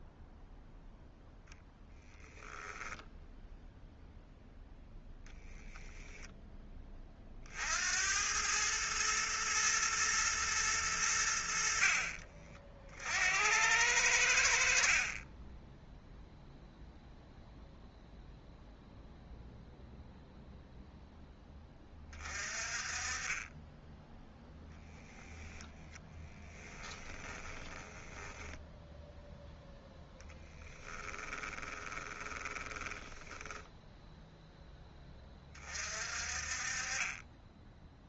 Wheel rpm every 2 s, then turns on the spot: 0, 0, 10, 20, 110, 110, 50, 50, 0, 0, 0, 30, 0, 10, 0, 10, 10, 10, 30.
26-28 30-34